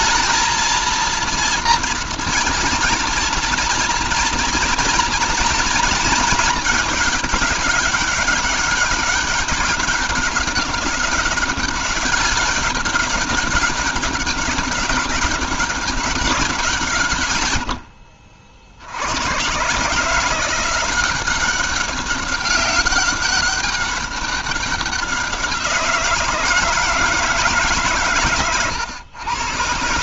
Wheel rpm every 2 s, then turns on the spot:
230, 230, 240, 220, 200, 200, 200, 200, 180, 70, 180, 200, 190, 160, 110.
none